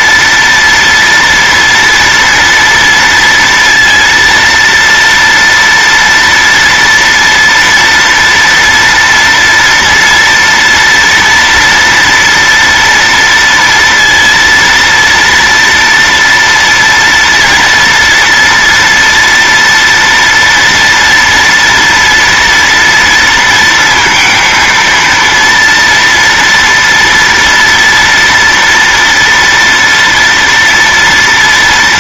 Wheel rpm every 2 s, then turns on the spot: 230, 230, 230, 230, 230, 230, 230, 230, 230, 230, 230, 230, 230, 230, 240, 230.
none